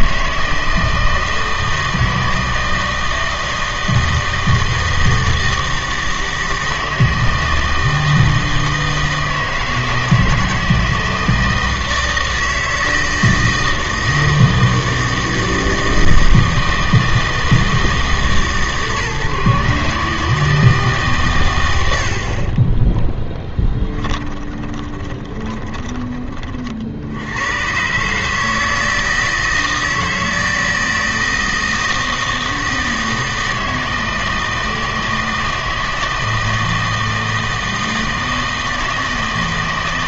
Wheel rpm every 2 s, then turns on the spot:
160, 160, 160, 160, 160, 160, 160, 160, 160, 140, 150, 20, 20, 50, 160, 160, 160, 160, 160, 160.
22-26